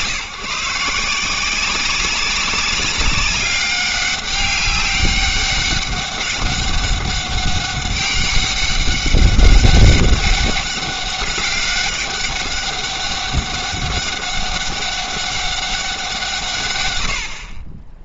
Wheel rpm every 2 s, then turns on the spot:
160, 200, 200, 200, 200, 200, 200, 200, 120.
none